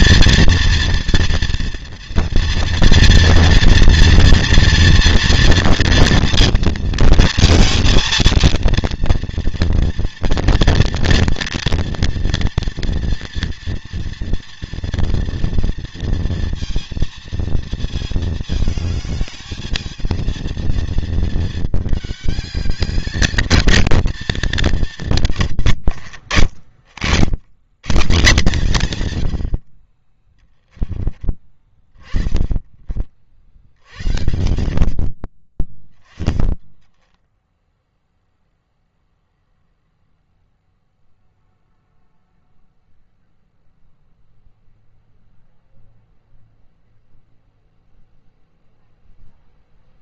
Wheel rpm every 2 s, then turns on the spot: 230, 230, 230, 230, 230, 230, 230, 240, 230, 220, 230, 210, 200, 70, 150, 10, 20, 60, 10, 0, 0, 0, 0, 0, 0.
30-32 36-38